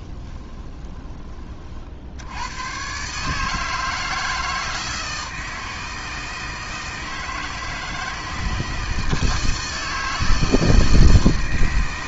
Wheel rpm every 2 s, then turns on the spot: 20, 120, 160, 160, 160, 160.
0-2